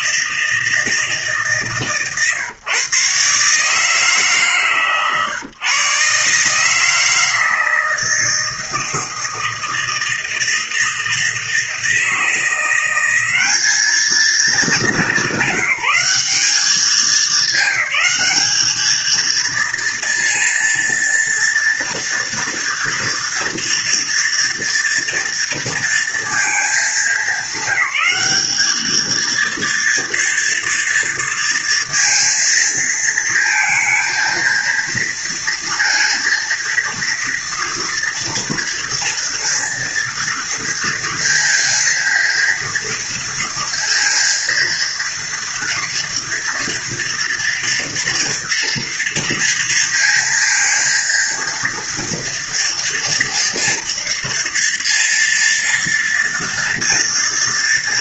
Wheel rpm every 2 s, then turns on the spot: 160, 120, 140, 160, 160, 160, 180, 210, 200, 220, 230, 230, 230, 220, 220, 230, 230, 230, 230, 230, 230, 230, 230, 230, 230, 230, 230, 230, 230.
none